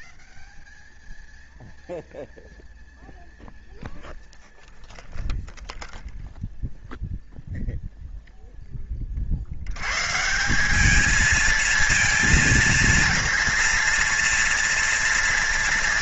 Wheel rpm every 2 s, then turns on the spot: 0, 0, 0, 0, 10, 190, 230, 230.
none